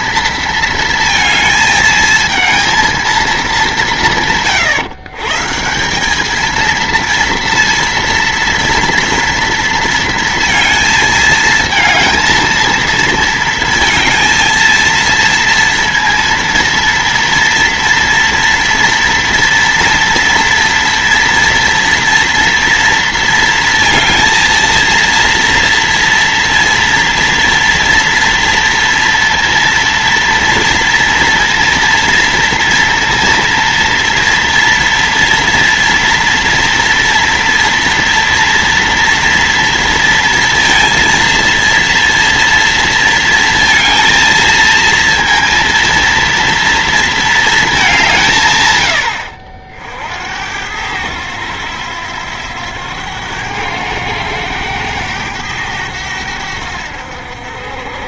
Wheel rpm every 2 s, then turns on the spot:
230, 230, 150, 230, 230, 220, 230, 230, 230, 240, 230, 230, 230, 230, 240, 230, 240, 230, 240, 230, 230, 230, 230, 230, 90, 90, 90, 100, 80.
none